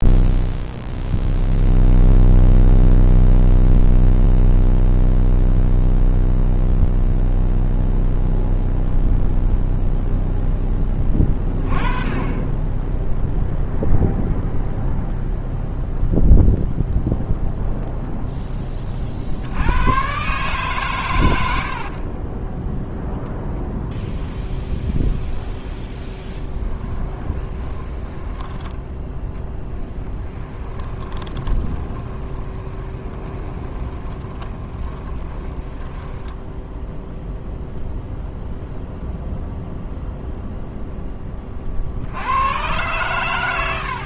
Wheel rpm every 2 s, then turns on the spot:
0, 0, 0, 0, 0, 10, 10, 0, 0, 30, 120, 0, 0, 20, 10, 20, 20, 20, 0, 0, 10, 110.
26-28 30-36